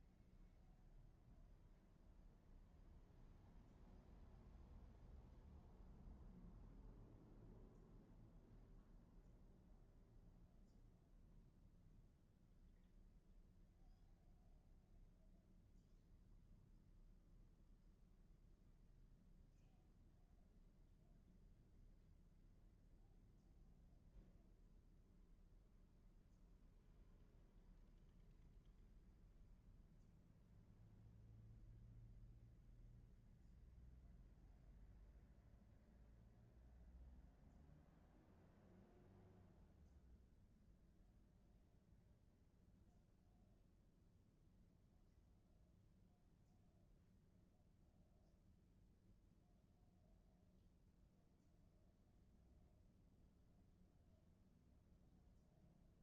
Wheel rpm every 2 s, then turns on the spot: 0, 0, 0, 0, 0, 0, 0, 0, 0, 0, 0, 0, 0, 0, 0, 0, 0, 0, 0, 0, 0, 0, 0, 0, 0, 0, 0, 0.
none